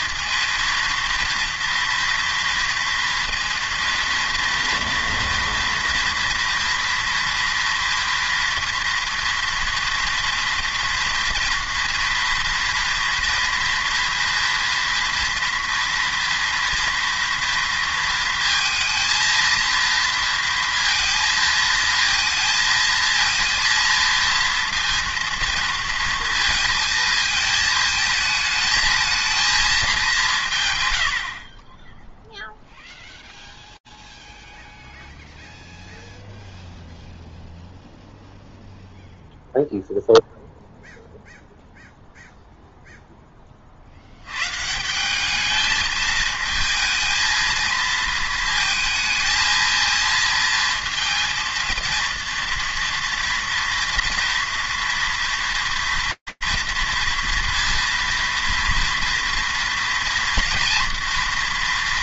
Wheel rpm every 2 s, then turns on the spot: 230, 230, 230, 230, 230, 230, 230, 230, 230, 220, 230, 230, 230, 230, 220, 150, 0, 0, 0, 0, 0, 0, 150, 220, 230, 230, 240, 230, 230, 240, 230.
none